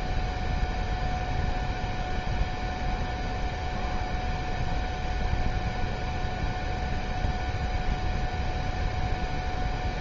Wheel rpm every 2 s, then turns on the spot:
0, 0, 0, 0, 0.
none